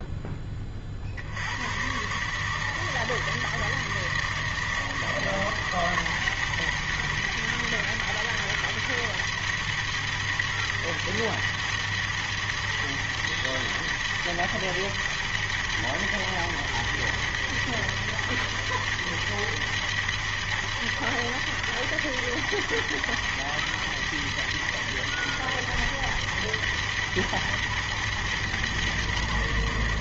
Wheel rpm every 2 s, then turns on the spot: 20, 160, 160, 160, 160, 160, 160, 160, 160, 160, 160, 160, 160, 160, 160.
none